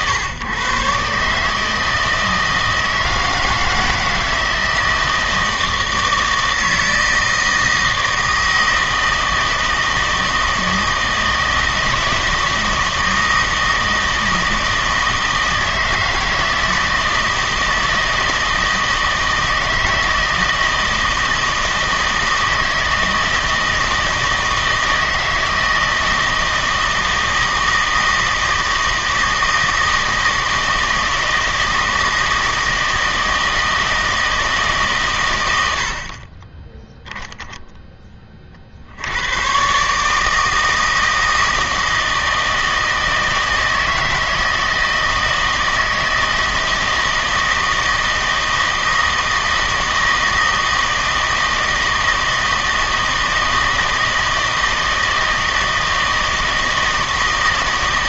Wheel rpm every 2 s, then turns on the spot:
130, 160, 160, 160, 160, 160, 160, 160, 160, 160, 160, 160, 160, 160, 160, 160, 160, 150, 10, 40, 160, 160, 160, 160, 160, 160, 160, 160, 160.
none